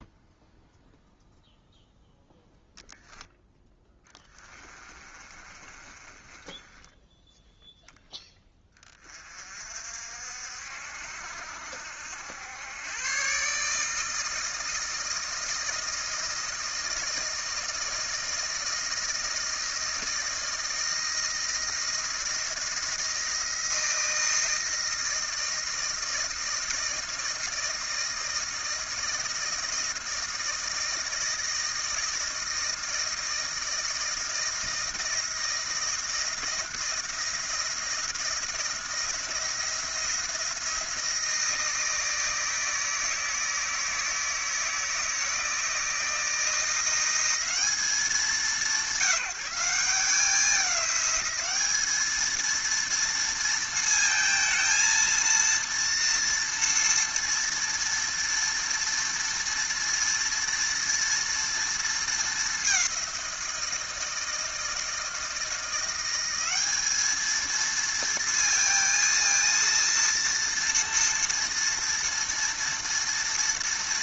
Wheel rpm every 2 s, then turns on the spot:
0, 0, 20, 10, 20, 60, 110, 160, 160, 160, 160, 160, 160, 160, 160, 160, 160, 160, 170, 170, 170, 160, 160, 170, 180, 200, 230, 230, 230, 230, 230, 190, 160, 210, 230, 230, 230.
4-8